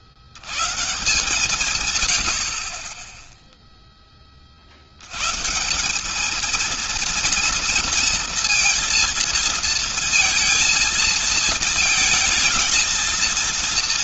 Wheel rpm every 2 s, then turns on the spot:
50, 70, 70, 230, 230, 230, 230.
none